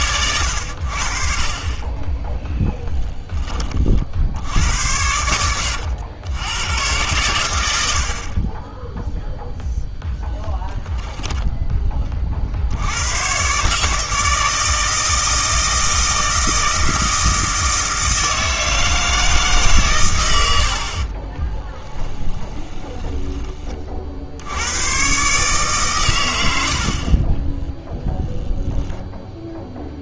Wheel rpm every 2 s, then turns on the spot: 70, 0, 80, 110, 10, 10, 80, 160, 160, 160, 70, 10, 100, 50, 0.
10-12 20-24 26-28